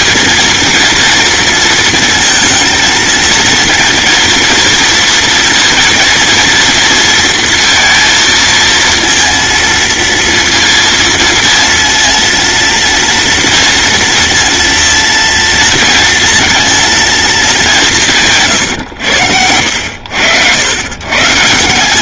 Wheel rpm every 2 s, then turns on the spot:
230, 230, 240, 230, 230, 230, 230, 230, 230, 110, 110.
none